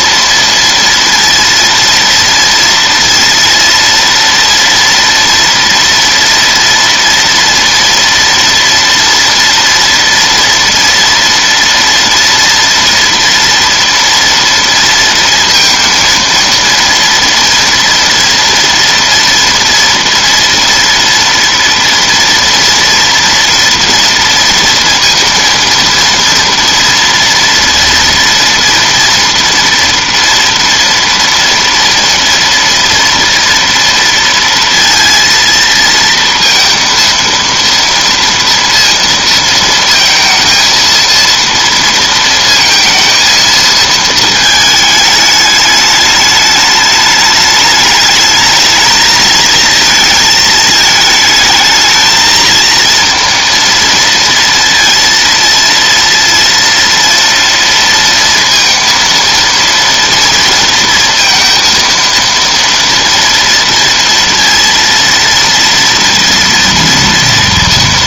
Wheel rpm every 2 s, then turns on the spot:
230, 230, 230, 230, 230, 230, 230, 230, 230, 230, 240, 230, 230, 230, 230, 230, 230, 230, 230, 230, 230, 230, 220, 210, 220, 220, 230, 230, 230, 230, 230, 230, 230, 240.
none